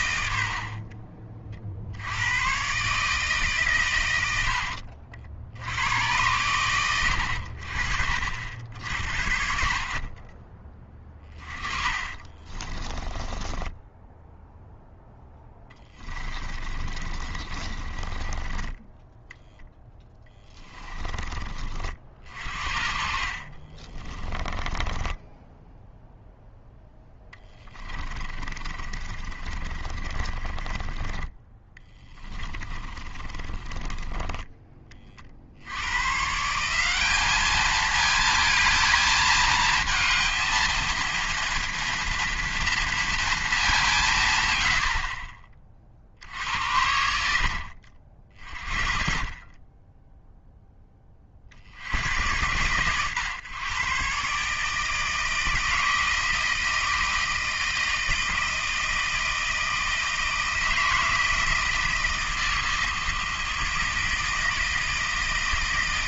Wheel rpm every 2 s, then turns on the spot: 40, 130, 70, 100, 60, 20, 20, 0, 30, 10, 20, 60, 20, 0, 30, 20, 40, 20, 180, 220, 230, 230, 70, 80, 40, 10, 120, 150, 160, 160, 160, 160, 160.
12-14 16-20 22-26 28-34